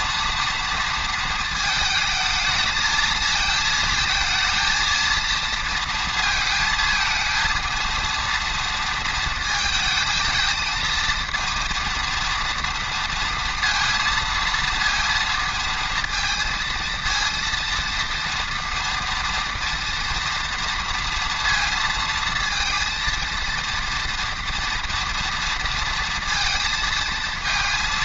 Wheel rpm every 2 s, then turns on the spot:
230, 220, 230, 220, 230, 220, 230, 230, 230, 230, 230, 230, 230, 220.
none